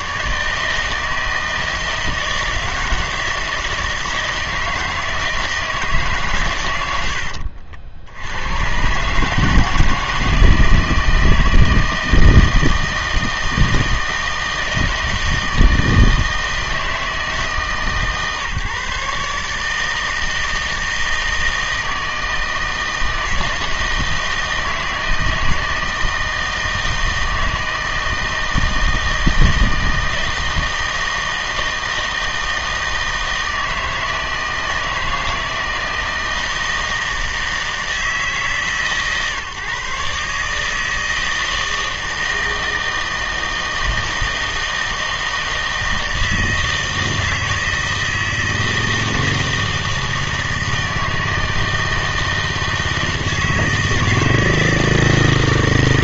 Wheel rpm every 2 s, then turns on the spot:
160, 160, 160, 120, 120, 160, 160, 160, 160, 150, 160, 160, 160, 160, 160, 160, 160, 160, 160, 140, 150, 160, 160, 160, 160, 160, 160, 160.
none